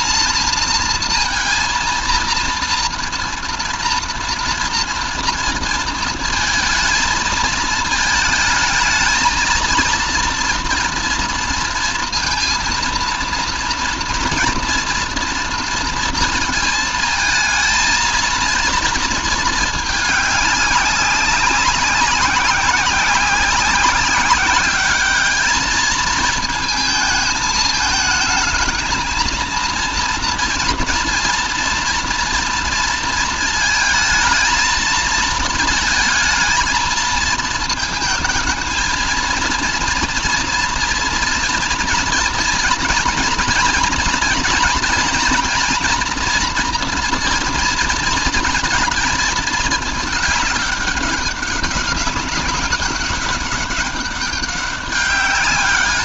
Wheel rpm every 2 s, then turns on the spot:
230, 230, 230, 220, 220, 240, 230, 230, 230, 230, 200, 190, 200, 220, 220, 230, 230, 220, 230, 230, 230, 230, 230, 240, 230, 200, 200, 200.
none